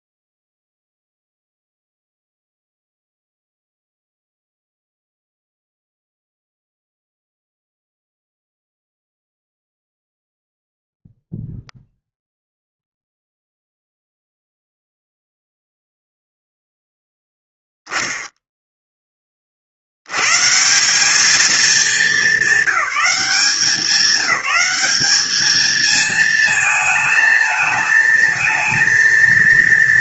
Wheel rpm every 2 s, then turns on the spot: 0, 0, 0, 0, 0, 0, 0, 0, 0, 10, 170, 200, 200, 220, 220.
none